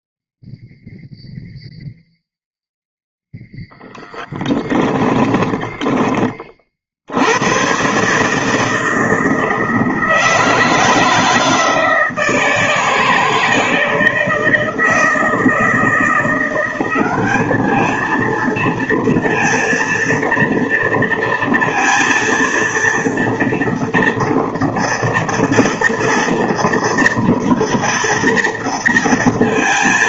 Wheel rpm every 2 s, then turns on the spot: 0, 0, 10, 90, 160, 160, 160, 160, 200, 230, 230, 230, 230, 230, 230.
4-6